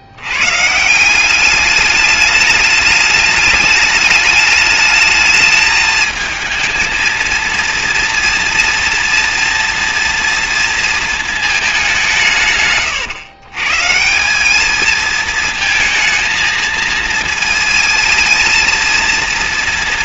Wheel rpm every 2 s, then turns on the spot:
130, 210, 210, 220, 230, 230, 140, 200, 220, 230.
none